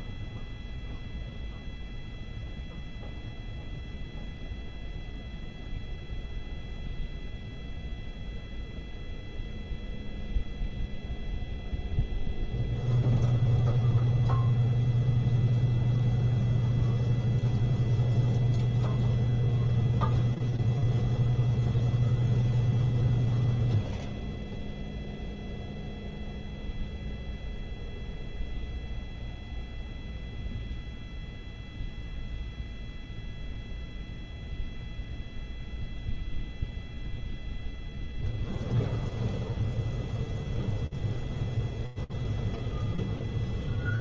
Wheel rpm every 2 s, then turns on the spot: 0, 0, 0, 0, 0, 0, 0, 0, 0, 0, 0, 0, 0, 0, 0, 0, 0, 0, 0, 0, 0, 0.
none